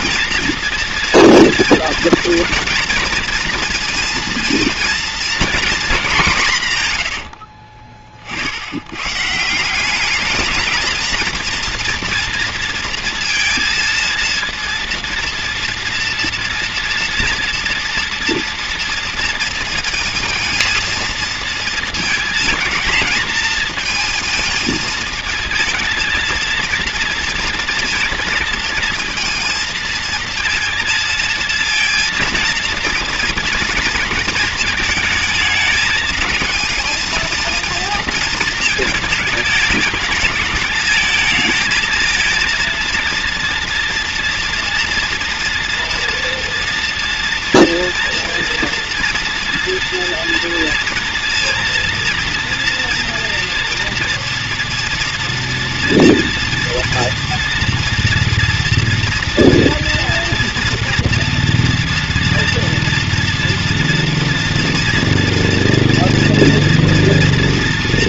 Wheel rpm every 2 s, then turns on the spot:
230, 230, 230, 140, 70, 220, 230, 230, 230, 230, 230, 220, 220, 230, 230, 230, 230, 230, 220, 230, 210, 230, 230, 230, 230, 230, 230, 230, 240, 230, 230, 230, 230, 240.
none